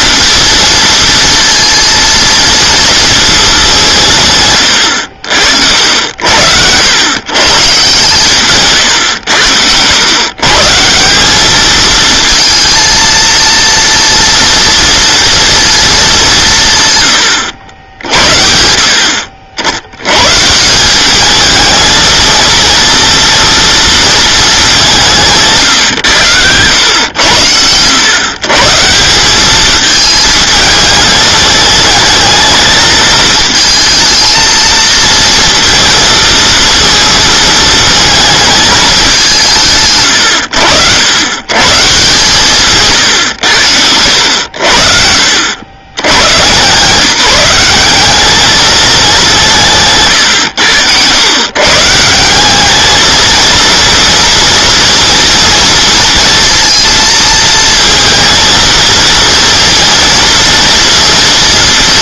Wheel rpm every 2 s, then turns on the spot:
230, 220, 80, 120, 110, 180, 230, 230, 120, 60, 190, 230, 170, 100, 170, 210, 220, 230, 230, 200, 100, 130, 60, 160, 200, 110, 220, 240, 230, 230, 230.
none